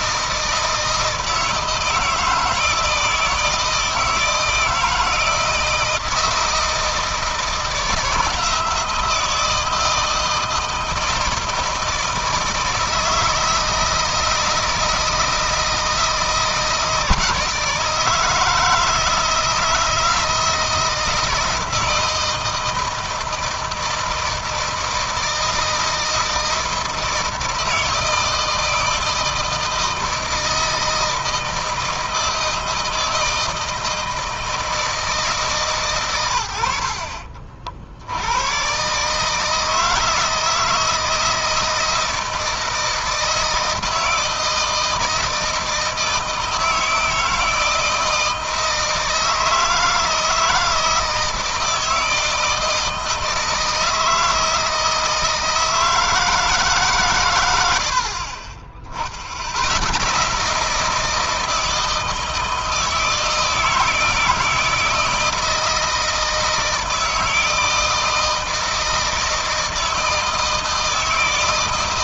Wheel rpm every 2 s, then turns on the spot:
160, 160, 160, 160, 170, 160, 160, 160, 160, 160, 170, 160, 160, 160, 160, 160, 160, 160, 60, 130, 160, 160, 160, 160, 160, 160, 160, 160, 140, 40, 160, 160, 160, 160, 160, 160.
none